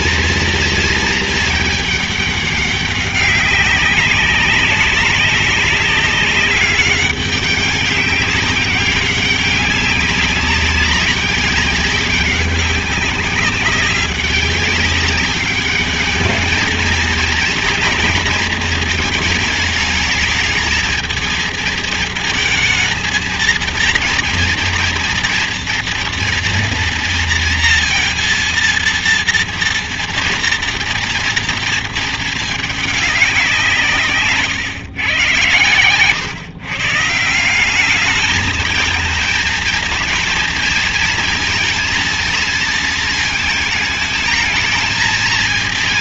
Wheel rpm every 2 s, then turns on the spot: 230, 200, 200, 200, 200, 200, 200, 190, 220, 220, 220, 220, 230, 230, 230, 230, 210, 120, 140, 220, 230, 230, 220.
none